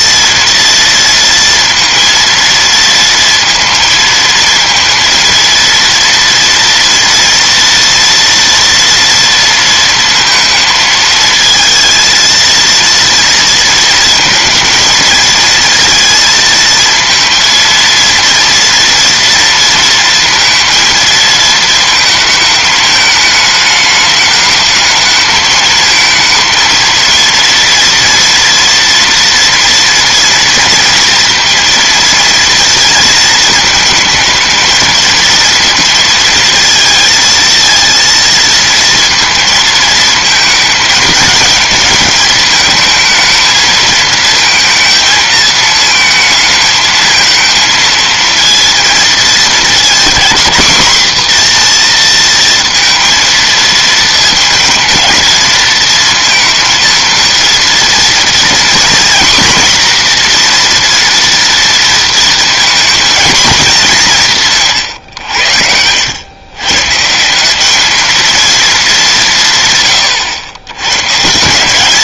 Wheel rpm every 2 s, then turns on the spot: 230, 230, 230, 230, 230, 220, 230, 220, 220, 230, 230, 220, 210, 230, 230, 230, 230, 220, 230, 230, 220, 220, 220, 220, 230, 230, 230, 230, 230, 240, 240, 230, 140, 130, 210, 110.
none